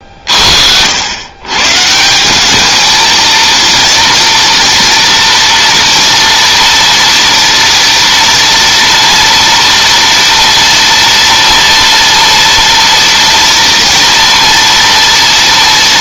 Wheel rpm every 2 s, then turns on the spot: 40, 180, 230, 230, 230, 230, 230, 230.
none